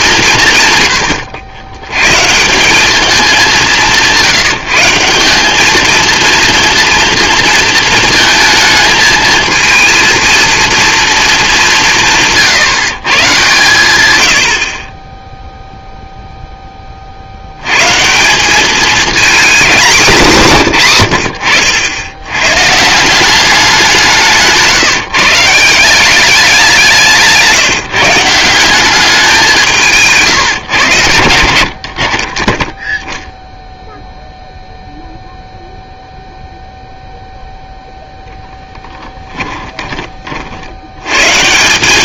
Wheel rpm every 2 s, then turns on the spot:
150, 180, 170, 230, 220, 230, 140, 50, 20, 200, 130, 120, 150, 190, 180, 120, 10, 0, 0, 0, 60.
24-26